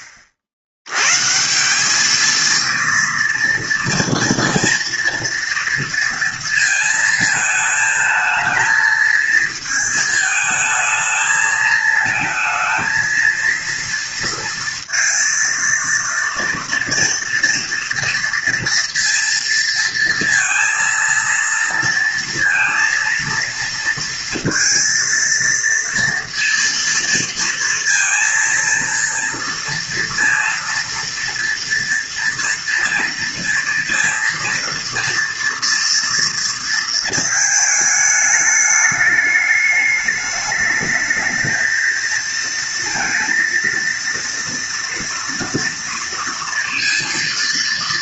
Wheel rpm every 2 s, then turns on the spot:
80, 230, 230, 230, 220, 220, 220, 230, 230, 230, 230, 230, 230, 230, 230, 230, 230, 230, 230, 210, 210, 230, 230, 230.
none